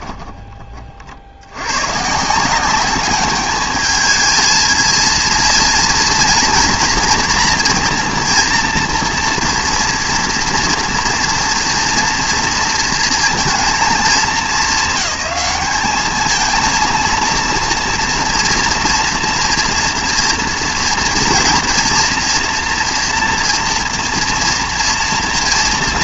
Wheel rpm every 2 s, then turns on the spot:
40, 200, 230, 230, 230, 230, 230, 210, 230, 230, 230, 240, 230.
none